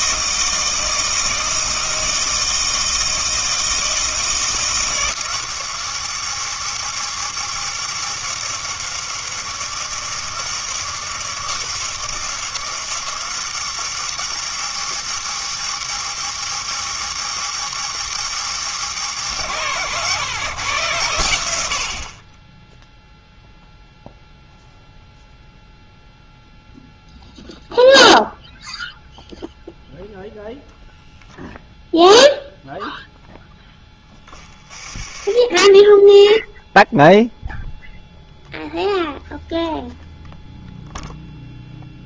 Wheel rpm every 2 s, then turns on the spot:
160, 160, 160, 160, 160, 160, 160, 160, 160, 150, 140, 10, 0, 0, 0, 0, 0, 30, 0, 0, 0.
34-36